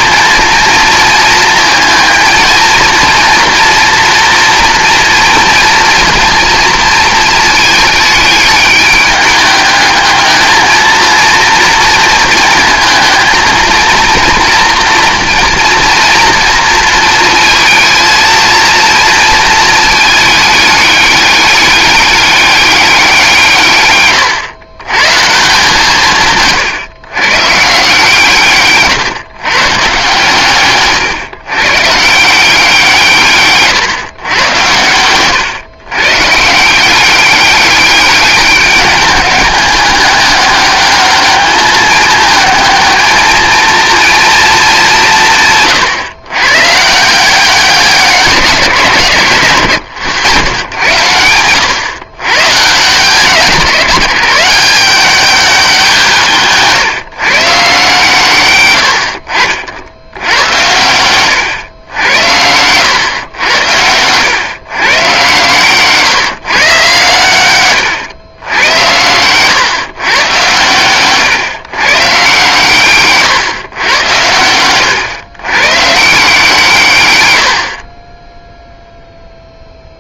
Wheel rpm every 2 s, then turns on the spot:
230, 230, 240, 230, 210, 220, 220, 230, 230, 230, 210, 200, 110, 140, 150, 140, 170, 110, 160, 200, 200, 220, 210, 130, 170, 100, 130, 170, 150, 100, 100, 100, 130, 140, 100, 120, 140, 100, 140, 0.
none